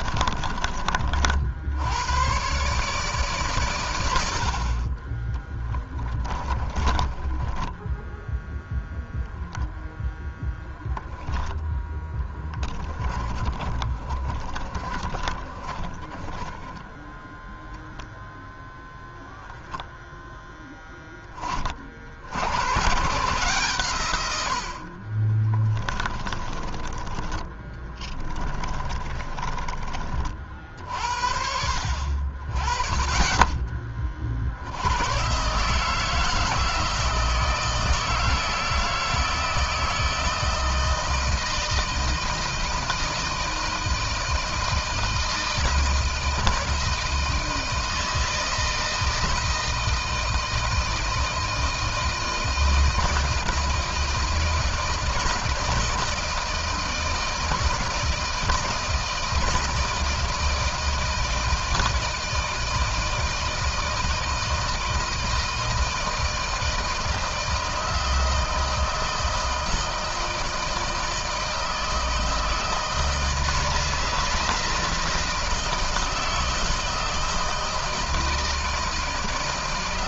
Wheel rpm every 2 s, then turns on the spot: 40, 130, 40, 30, 0, 10, 20, 30, 10, 0, 10, 120, 50, 20, 20, 50, 30, 90, 160, 160, 160, 160, 160, 160, 160, 160, 160, 160, 160, 160, 160, 160, 160, 160, 160, 160, 160, 160, 160, 160.
6-8 12-18 26-30